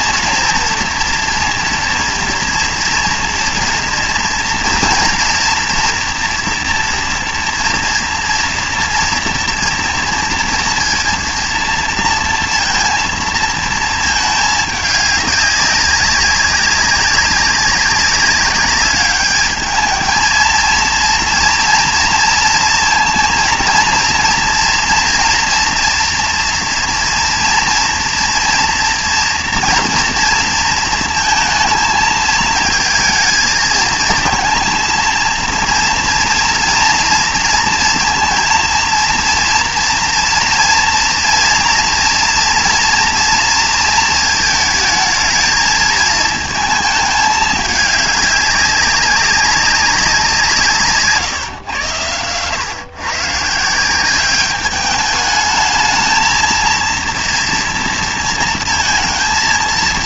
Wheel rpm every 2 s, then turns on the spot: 230, 230, 230, 230, 230, 230, 230, 210, 200, 200, 230, 230, 230, 230, 230, 230, 220, 230, 230, 230, 230, 230, 220, 220, 200, 160, 130, 200, 230, 230.
none